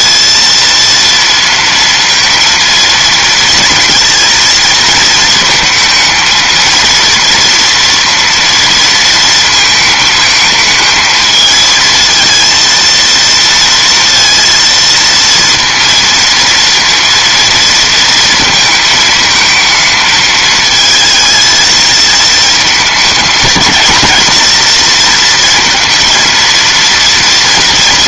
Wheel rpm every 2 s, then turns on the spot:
230, 230, 230, 230, 230, 220, 230, 230, 230, 220, 220, 220, 230, 230.
none